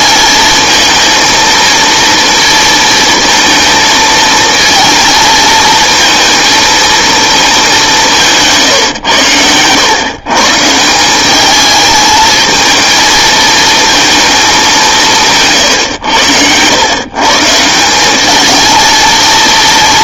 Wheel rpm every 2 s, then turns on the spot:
230, 220, 230, 230, 110, 180, 220, 170, 130, 230.
none